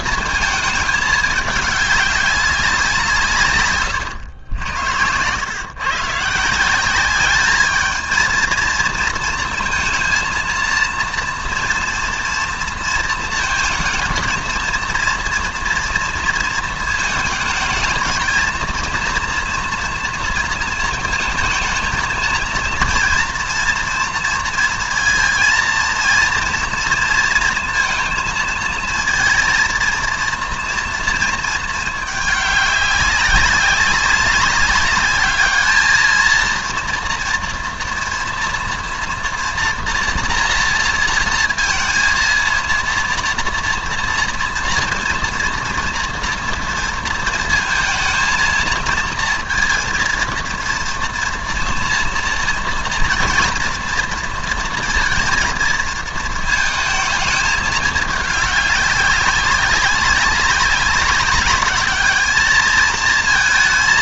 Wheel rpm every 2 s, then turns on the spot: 220, 190, 90, 170, 230, 230, 230, 230, 230, 230, 230, 230, 230, 230, 230, 230, 200, 200, 230, 230, 230, 230, 230, 230, 230, 230, 240, 230, 220, 210, 200, 220.
none